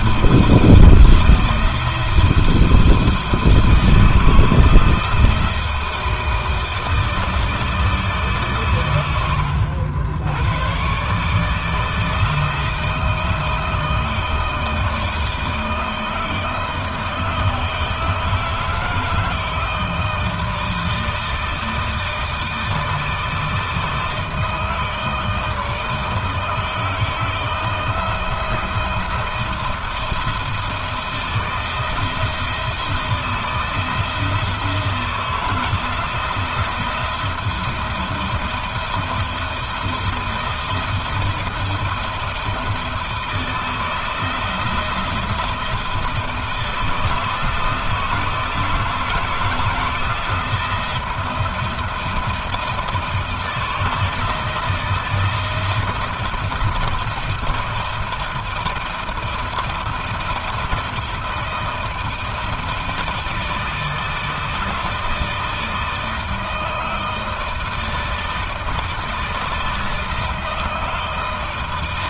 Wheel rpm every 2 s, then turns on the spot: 170, 170, 170, 160, 110, 130, 160, 160, 160, 160, 160, 160, 160, 160, 170, 170, 160, 160, 170, 170, 170, 160, 170, 160, 170, 170, 160, 160, 170, 170, 170, 160, 160, 160, 160, 160.
none